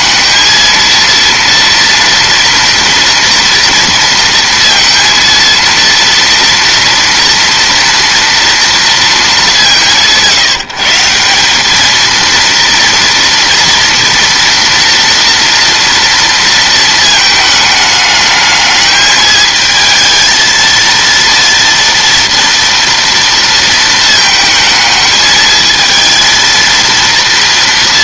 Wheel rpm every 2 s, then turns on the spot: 230, 230, 230, 230, 230, 160, 230, 230, 230, 210, 220, 230, 220, 230.
none